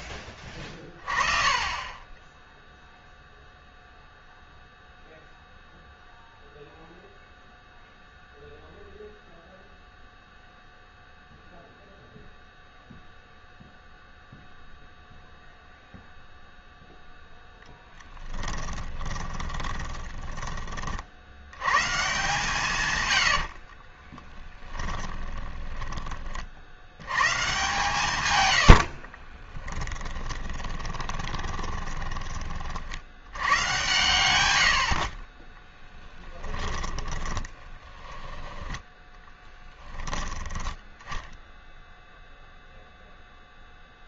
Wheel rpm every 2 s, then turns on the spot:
20, 0, 0, 0, 0, 0, 0, 0, 0, 20, 50, 140, 20, 90, 80, 20, 50, 80, 20, 10, 10, 0.
18-20 22-26 28-32 36-38